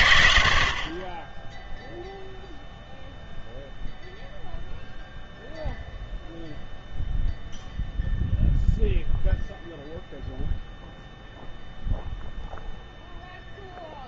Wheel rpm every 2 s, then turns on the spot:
50, 0, 0, 0, 0, 0, 0.
none